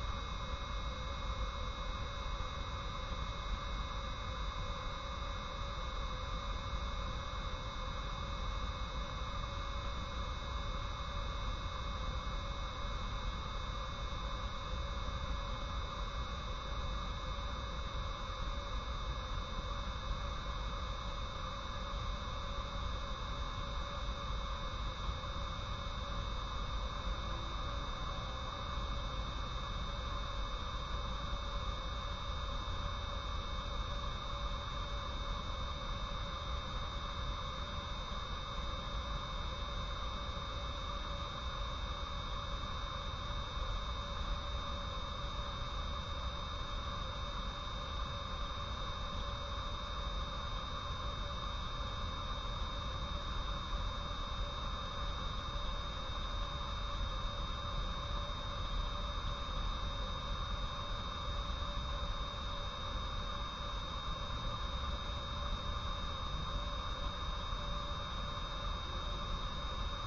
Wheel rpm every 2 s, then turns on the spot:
0, 0, 0, 0, 0, 0, 0, 0, 0, 0, 0, 0, 0, 0, 0, 0, 0, 0, 0, 0, 0, 0, 0, 0, 0, 0, 0, 0, 0, 0, 0, 0, 0, 0, 0.
none